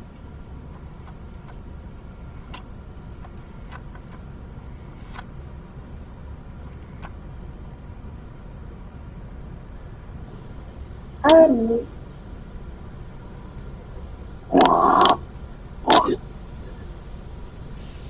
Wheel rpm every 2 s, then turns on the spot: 0, 0, 0, 0, 0, 0, 0, 0, 0.
none